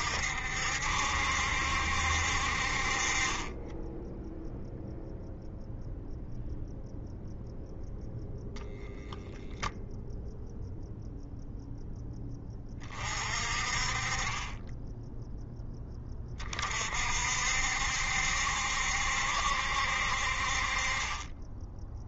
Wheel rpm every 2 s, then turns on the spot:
70, 40, 0, 0, 0, 0, 30, 10, 50, 70, 30.
none